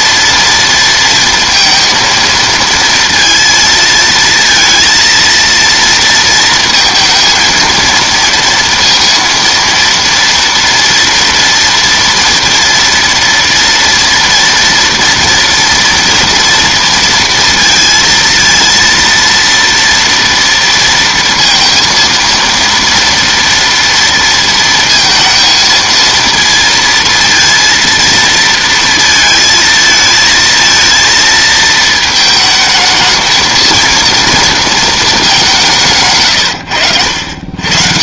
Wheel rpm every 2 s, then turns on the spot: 230, 230, 230, 230, 230, 230, 230, 230, 230, 230, 230, 230, 230, 230, 230, 230, 220, 230, 100.
none